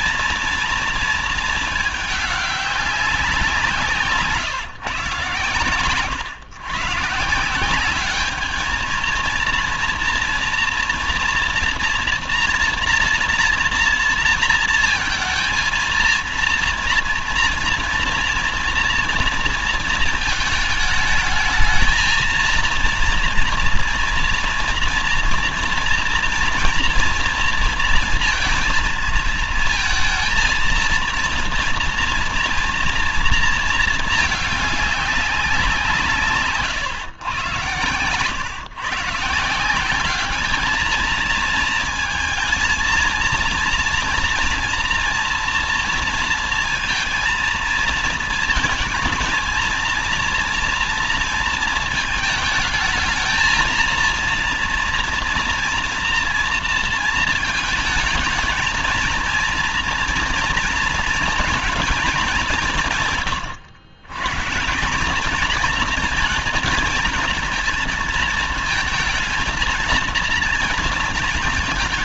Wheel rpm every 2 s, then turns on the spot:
230, 200, 150, 140, 220, 240, 230, 230, 230, 230, 220, 230, 230, 230, 230, 230, 240, 210, 150, 130, 210, 230, 240, 230, 220, 230, 220, 230, 230, 220, 230, 190, 160, 220, 230, 230.
none